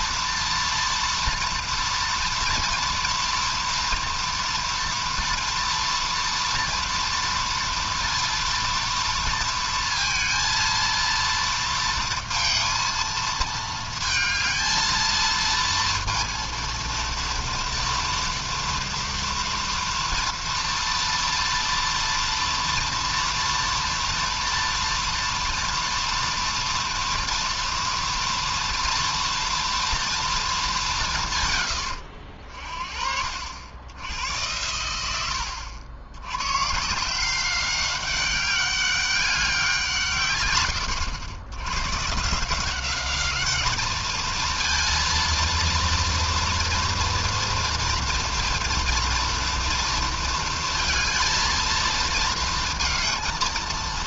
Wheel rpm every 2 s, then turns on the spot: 230, 230, 230, 230, 230, 230, 230, 220, 230, 230, 230, 230, 230, 230, 230, 220, 60, 100, 120, 200, 120, 170, 230, 230, 230, 230, 230.
none